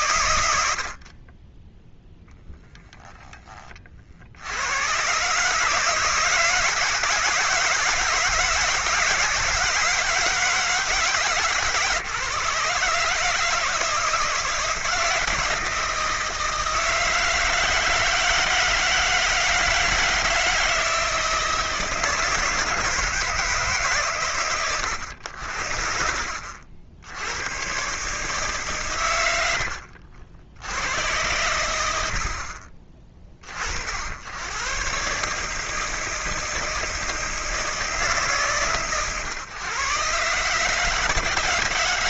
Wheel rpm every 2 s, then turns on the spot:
50, 10, 110, 160, 160, 150, 150, 160, 160, 160, 160, 160, 90, 70, 130, 70, 30, 120, 160, 130, 160.
2-4